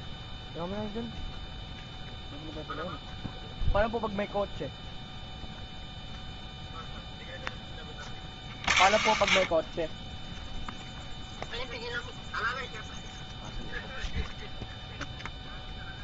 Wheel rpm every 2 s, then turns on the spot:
0, 0, 0, 0, 30, 0, 0, 0.
none